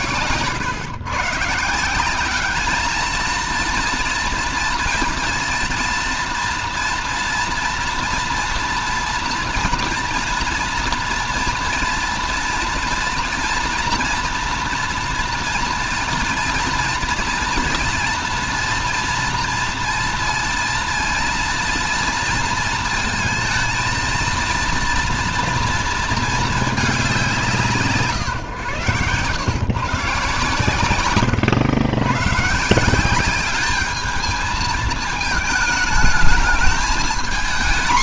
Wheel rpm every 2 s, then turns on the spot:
130, 220, 230, 230, 230, 240, 230, 230, 230, 230, 230, 230, 230, 210, 130, 120, 170, 220, 220.
28-30